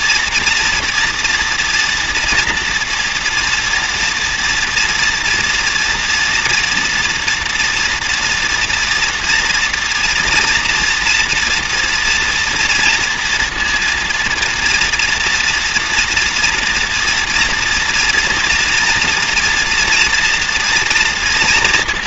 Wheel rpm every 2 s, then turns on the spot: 230, 230, 230, 230, 240, 240, 230, 230, 230, 230, 240.
none